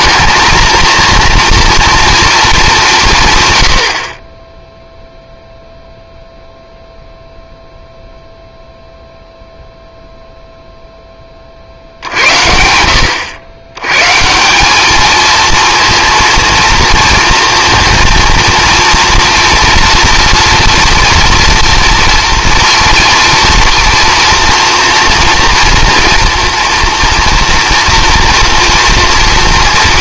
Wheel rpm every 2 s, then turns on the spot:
230, 200, 0, 0, 0, 0, 80, 200, 230, 230, 230, 230, 230, 230, 230.
none